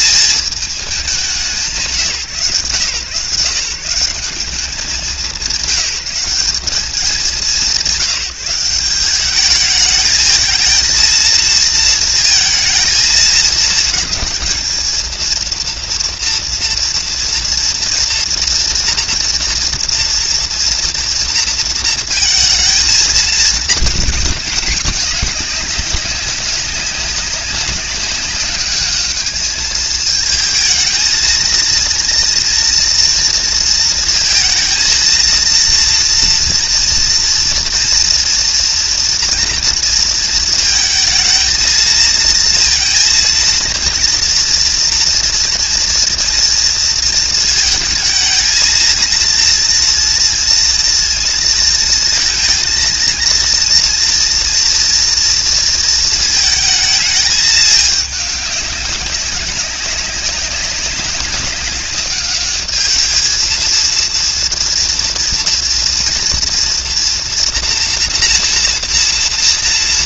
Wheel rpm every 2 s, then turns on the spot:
220, 140, 180, 180, 180, 220, 230, 220, 230, 230, 230, 230, 210, 200, 210, 220, 240, 230, 230, 230, 230, 230, 230, 230, 220, 230, 230, 230, 220, 210, 200, 210, 230, 230, 230.
none